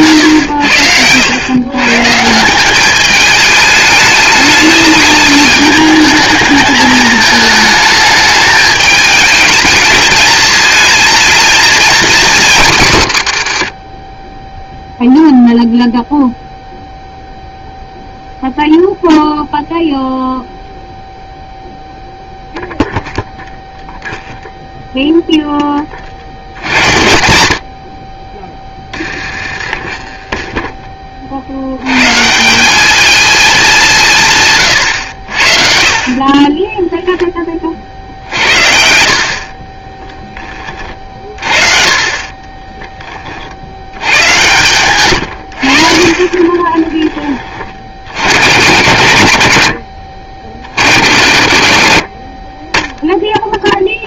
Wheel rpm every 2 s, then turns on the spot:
100, 190, 210, 210, 210, 220, 200, 10, 0, 0, 0, 0, 0, 70, 20, 10, 170, 140, 20, 60, 20, 30, 110, 30, 90, 50, 20.
26-32 36-38 42-48